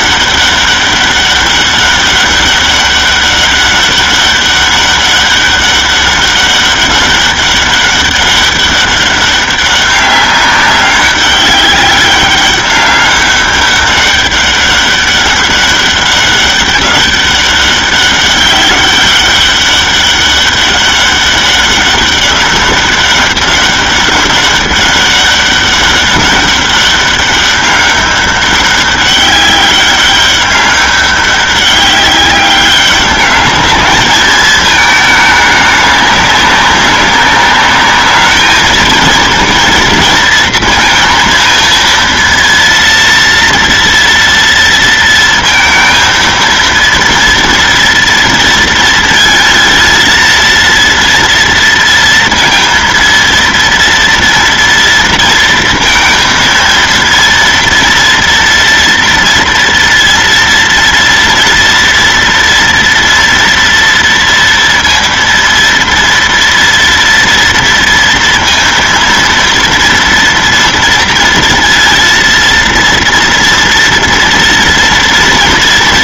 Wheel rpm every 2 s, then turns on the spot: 200, 200, 200, 200, 200, 200, 200, 200, 200, 200, 200, 200, 200, 200, 200, 200, 200, 220, 200, 220, 230, 230, 230, 230, 230, 230, 230, 230, 230, 240, 230, 230, 230, 230, 230, 230, 230, 230.
none